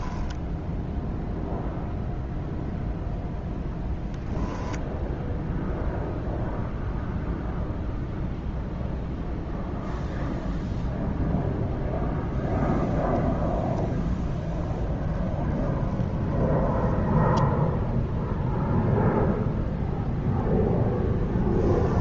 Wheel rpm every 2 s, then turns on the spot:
0, 0, 0, 0, 0, 0, 0, 0, 10, 0, 0.
16-18